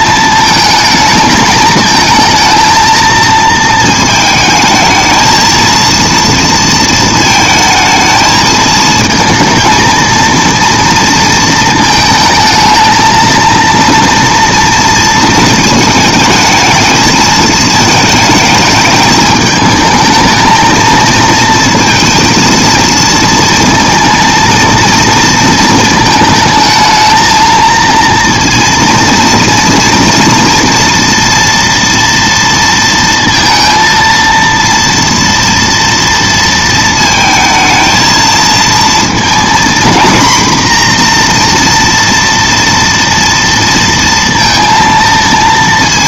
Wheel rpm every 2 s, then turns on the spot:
220, 230, 220, 220, 220, 230, 230, 230, 220, 220, 220, 230, 230, 220, 230, 230, 230, 230, 220, 230, 240, 240, 230.
none